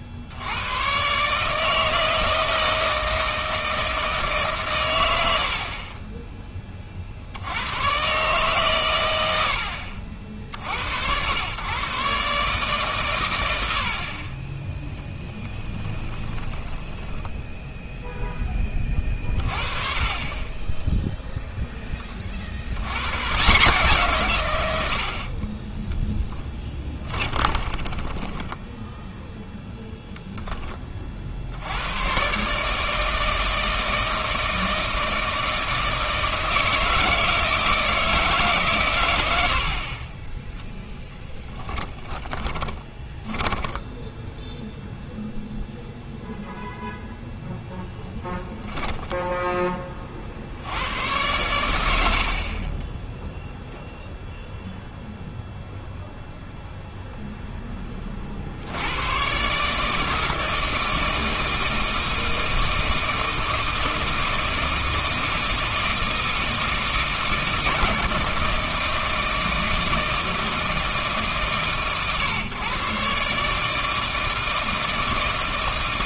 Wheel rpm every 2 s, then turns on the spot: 100, 160, 130, 20, 120, 70, 140, 10, 10, 20, 20, 70, 120, 20, 10, 10, 140, 160, 160, 140, 10, 10, 0, 0, 0, 80, 30, 0, 0, 70, 160, 160, 160, 160, 160, 160, 130, 160.
16-18 26-30 42-44